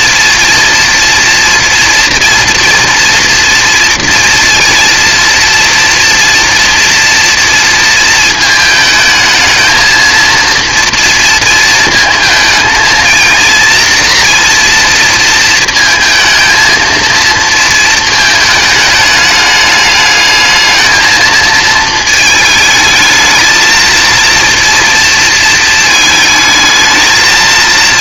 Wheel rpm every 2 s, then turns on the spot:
230, 230, 230, 230, 220, 230, 230, 230, 230, 220, 220, 220, 230, 220.
none